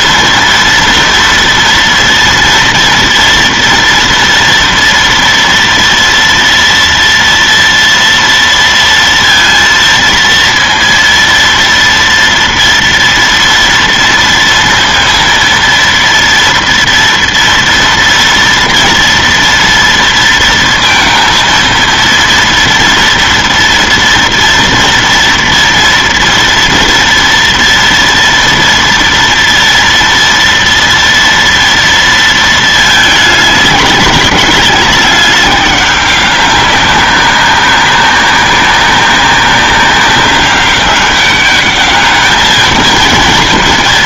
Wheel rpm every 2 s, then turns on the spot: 230, 230, 230, 230, 230, 230, 230, 230, 230, 240, 230, 230, 230, 230, 230, 230, 220, 200, 200, 200, 200, 220.
none